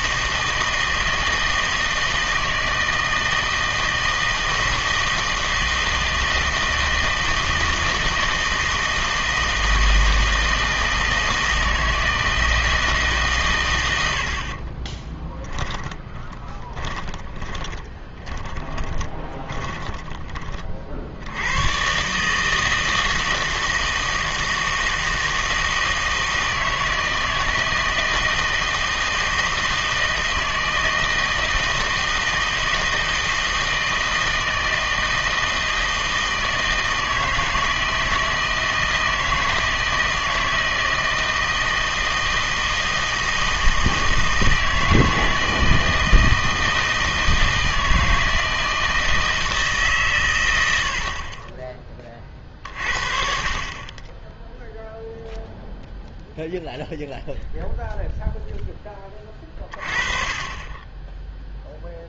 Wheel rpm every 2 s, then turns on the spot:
160, 160, 160, 160, 160, 160, 160, 40, 20, 20, 40, 160, 160, 160, 160, 160, 160, 160, 160, 160, 160, 160, 160, 160, 160, 90, 50, 0, 0, 10, 20.
14-20